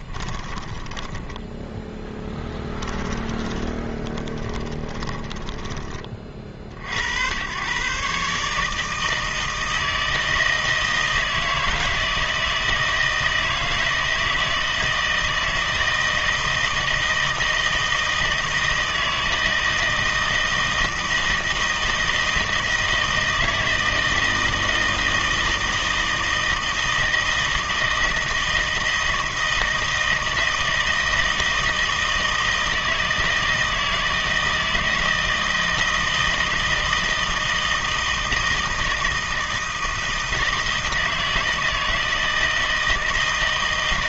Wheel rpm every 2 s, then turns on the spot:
10, 10, 20, 70, 150, 160, 160, 160, 160, 160, 160, 160, 160, 160, 160, 160, 160, 160, 160, 160, 160, 160.
0-6